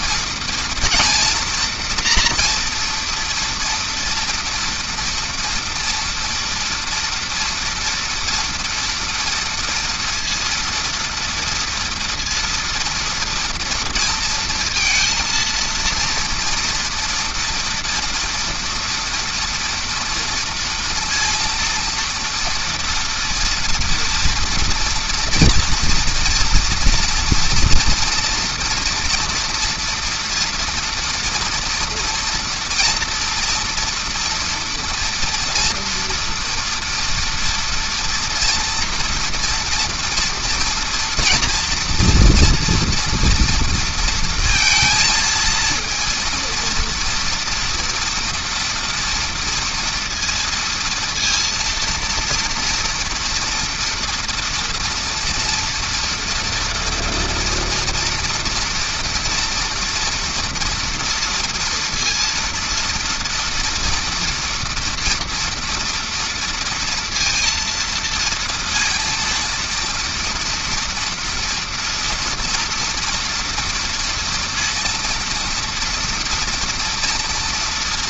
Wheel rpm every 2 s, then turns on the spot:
230, 230, 230, 230, 230, 230, 230, 230, 230, 230, 230, 230, 230, 230, 230, 230, 230, 230, 230, 240, 240, 240, 230, 230, 230, 230, 240, 230, 230, 230, 230, 230, 230, 230, 230, 240, 230, 230, 230.
none